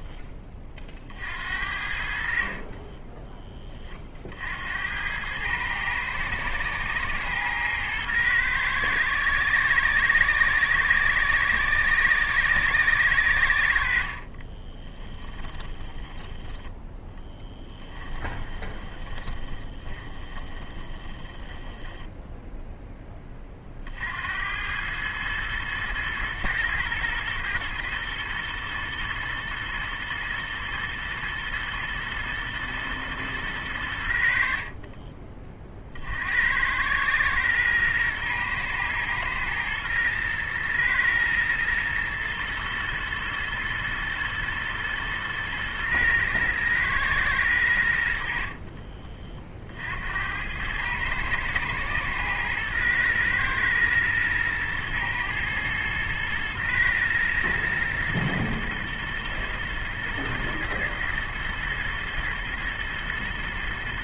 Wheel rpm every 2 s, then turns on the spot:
30, 40, 70, 110, 110, 120, 110, 20, 10, 20, 20, 10, 100, 110, 110, 110, 110, 40, 100, 120, 110, 120, 110, 110, 30, 100, 110, 110, 110, 110, 110, 110.
2-4 14-16 18-22 48-50